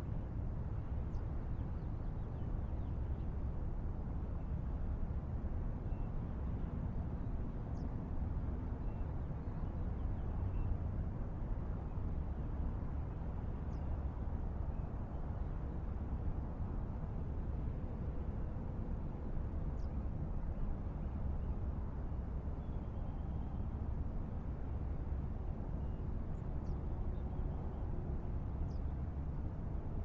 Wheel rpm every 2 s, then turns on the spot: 0, 0, 0, 0, 0, 0, 0, 0, 0, 0, 0, 0, 0, 0, 0.
none